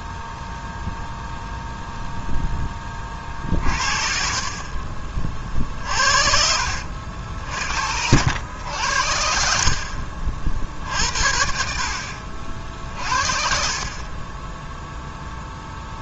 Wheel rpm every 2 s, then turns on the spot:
0, 20, 40, 70, 70, 60, 50, 0.
none